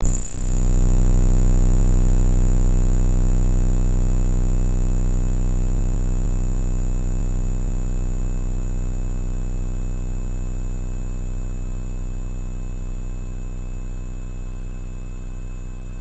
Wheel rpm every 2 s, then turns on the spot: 0, 0, 0, 0, 0, 0, 0, 0.
none